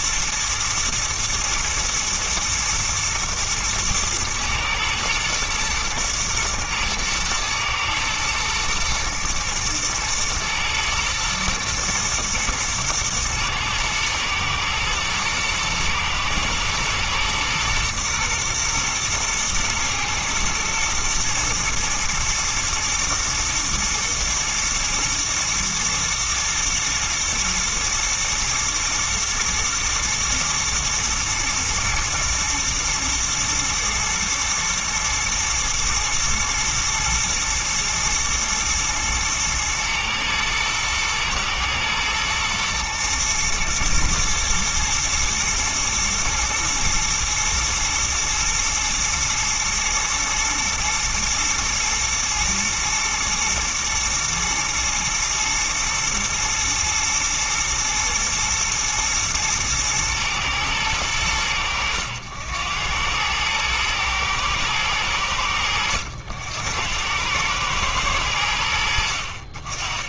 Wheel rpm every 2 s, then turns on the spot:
110, 110, 120, 110, 110, 110, 110, 110, 120, 120, 110, 120, 110, 110, 110, 110, 110, 120, 110, 110, 110, 110, 110, 120, 120, 110, 120, 120, 110, 120, 110, 90, 110, 90, 60.
none